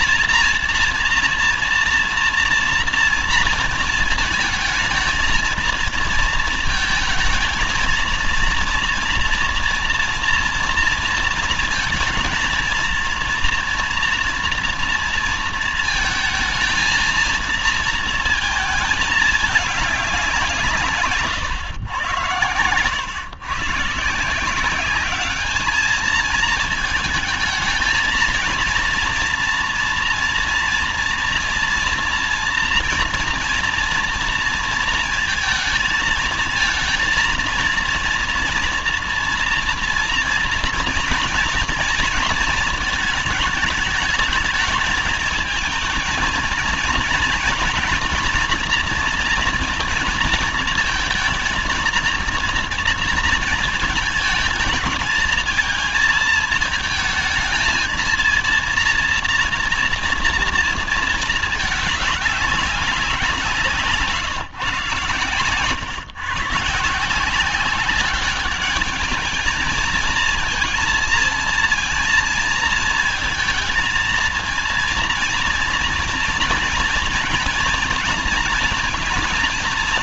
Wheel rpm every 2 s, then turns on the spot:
230, 230, 220, 220, 230, 230, 220, 230, 230, 220, 180, 90, 170, 220, 230, 230, 230, 230, 230, 230, 230, 220, 220, 230, 230, 220, 230, 230, 220, 230, 230, 200, 150, 140, 200, 230, 230, 230, 230, 230.
none